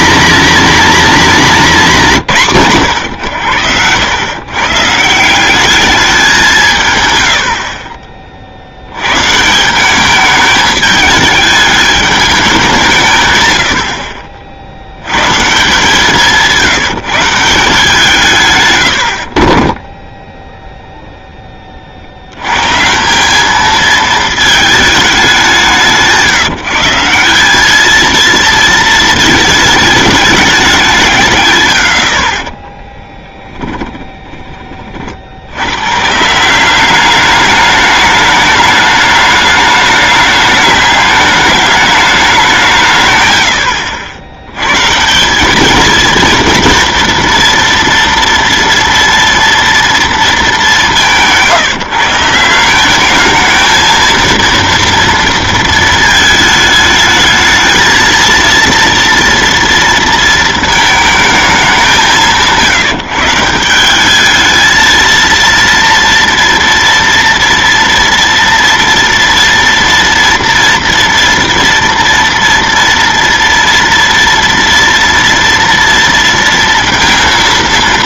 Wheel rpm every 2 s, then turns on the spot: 250, 140, 140, 150, 70, 210, 190, 80, 170, 110, 0, 140, 220, 160, 220, 180, 20, 20, 180, 210, 210, 160, 130, 240, 230, 200, 180, 230, 220, 230, 220, 160, 220, 230, 230, 230, 230, 240, 230.
32-34